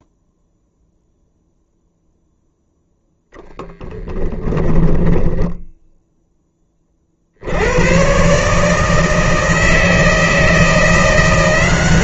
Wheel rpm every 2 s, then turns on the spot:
0, 0, 10, 30, 160, 160.
4-6